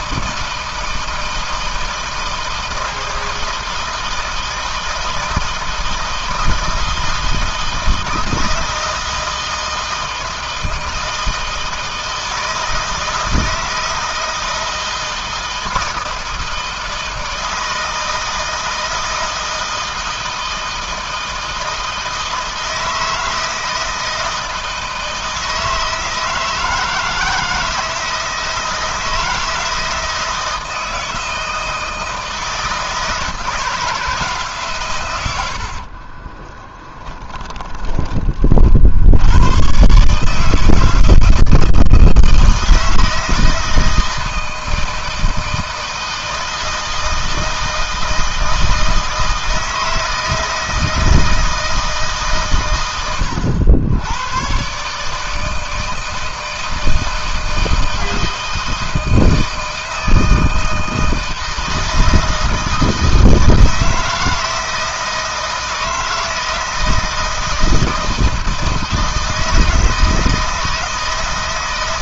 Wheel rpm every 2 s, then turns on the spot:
160, 160, 160, 160, 160, 160, 160, 160, 160, 160, 160, 160, 160, 160, 160, 160, 160, 140, 20, 60, 160, 160, 160, 160, 160, 160, 120, 130, 160, 160, 160, 160, 160, 160, 160, 160.
36-38